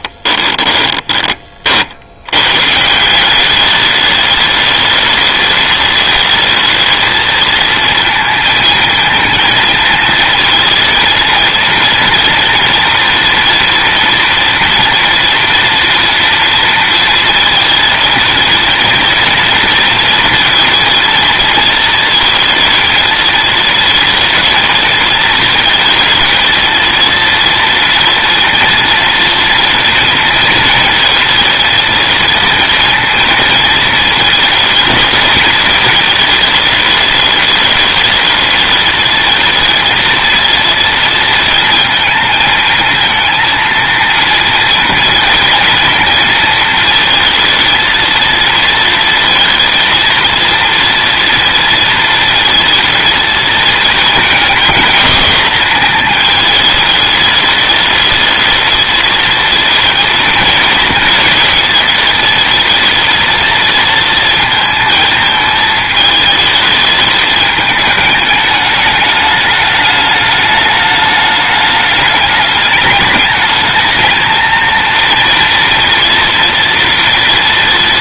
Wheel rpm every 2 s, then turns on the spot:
20, 160, 210, 220, 230, 230, 230, 230, 230, 230, 230, 220, 230, 230, 230, 220, 230, 220, 210, 220, 230, 230, 230, 230, 230, 230, 230, 220, 210, 220, 230, 230, 230, 220, 210, 210, 210, 230, 230.
0-2